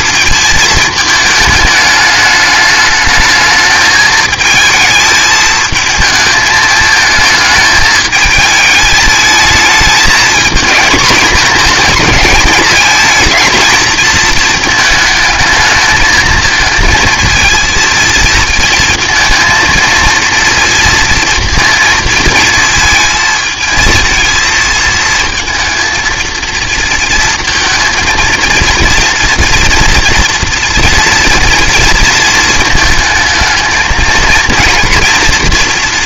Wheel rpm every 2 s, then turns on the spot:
220, 210, 220, 220, 220, 230, 220, 220, 230, 230, 230, 230, 230, 230, 230, 230, 220, 230.
none